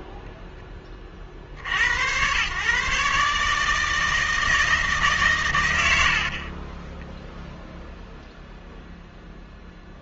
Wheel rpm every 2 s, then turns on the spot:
10, 130, 160, 20, 0.
6-8